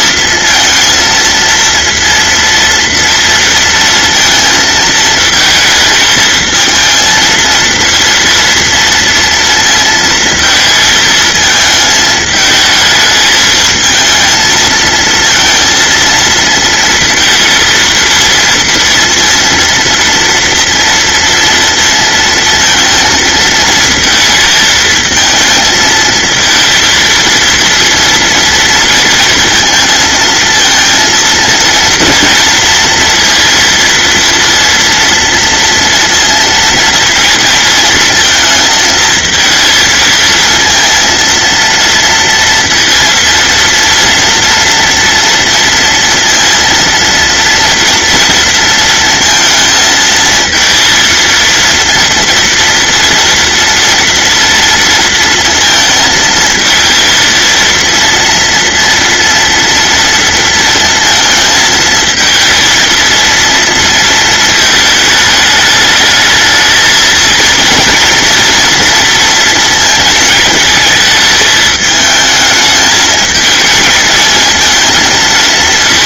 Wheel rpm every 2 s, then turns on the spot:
230, 230, 230, 220, 230, 230, 220, 220, 230, 230, 230, 230, 230, 220, 230, 230, 230, 230, 230, 230, 220, 230, 230, 230, 230, 230, 230, 230, 230, 230, 230, 220, 230, 210, 230, 230, 220, 220.
none